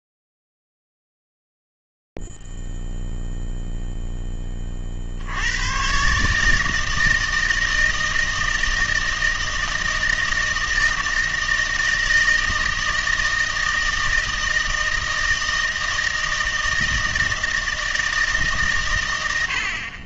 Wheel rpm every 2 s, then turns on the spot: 0, 0, 0, 130, 160, 160, 160, 160, 160, 150.
none